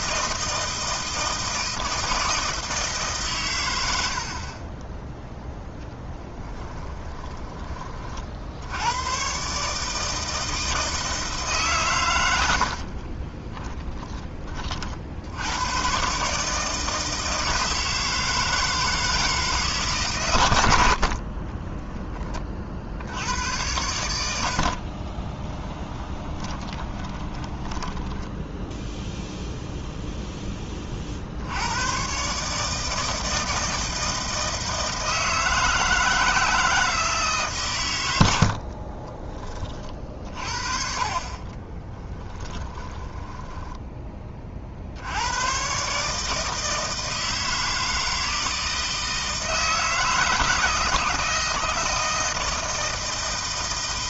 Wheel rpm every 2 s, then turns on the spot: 160, 160, 20, 10, 100, 160, 50, 50, 160, 160, 70, 60, 50, 30, 0, 30, 160, 160, 160, 40, 40, 10, 60, 160, 160, 160, 160.
12-14 24-28 38-40 42-44